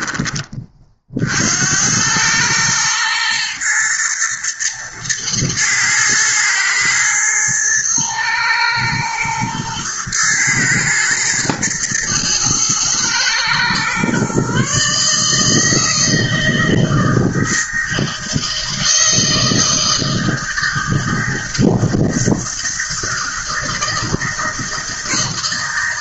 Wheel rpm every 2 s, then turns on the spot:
40, 110, 110, 110, 110, 120, 110, 150, 160, 160, 160, 160, 160.
none